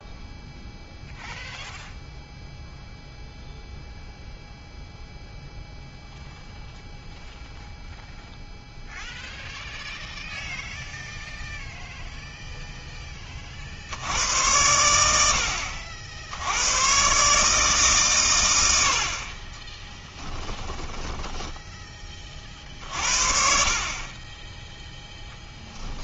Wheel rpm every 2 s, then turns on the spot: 0, 0, 0, 0, 0, 0, 0, 80, 110, 70, 10, 50, 10.
20-22